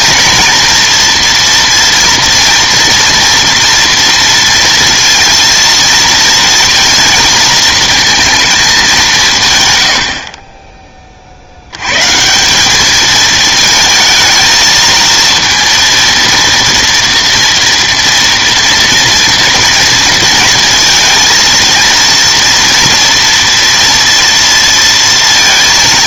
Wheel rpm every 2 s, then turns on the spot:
230, 230, 230, 230, 220, 30, 190, 220, 230, 240, 230, 230, 230.
none